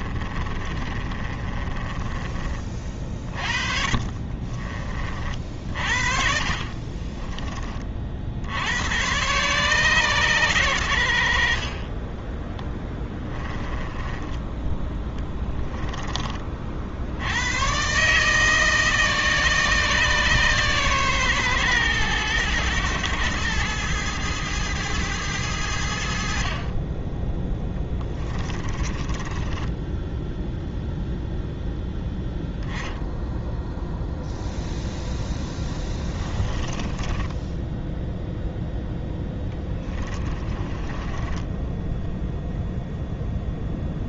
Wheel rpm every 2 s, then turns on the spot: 40, 50, 40, 30, 110, 80, 10, 10, 70, 150, 130, 110, 110, 20, 20, 0, 10, 0, 20, 10, 20, 0.
0-4 6-8 12-16 28-30 36-38 40-42